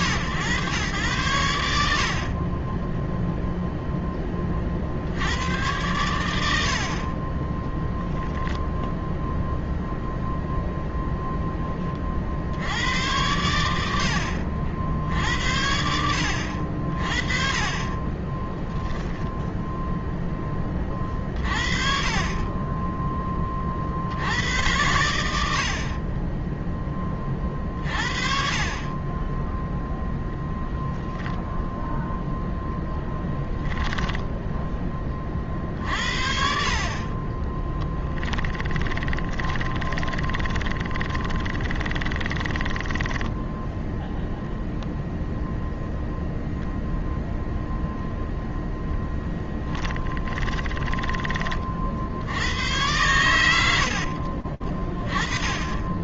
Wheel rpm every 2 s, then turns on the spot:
110, 20, 70, 50, 0, 0, 80, 70, 60, 20, 20, 20, 100, 30, 40, 0, 0, 10, 50, 20, 20, 20, 0, 0, 0, 10, 60, 60.
18-20 38-44 50-52 54-56